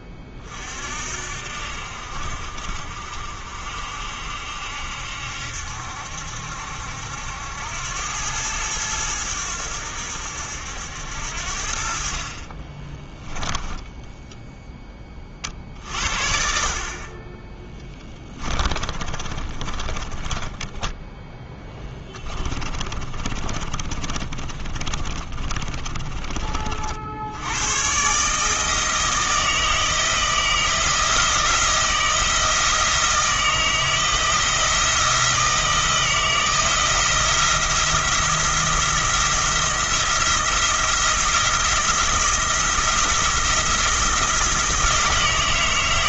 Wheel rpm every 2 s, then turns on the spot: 50, 60, 70, 70, 100, 80, 30, 10, 40, 20, 10, 30, 30, 40, 160, 170, 160, 170, 170, 170, 170, 170, 170.
12-14 18-26